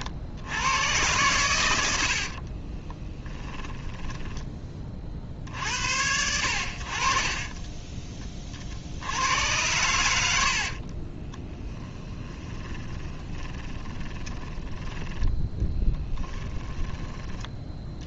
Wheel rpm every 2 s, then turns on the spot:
100, 20, 10, 70, 60, 40, 20, 10, 20.
2-4 10-14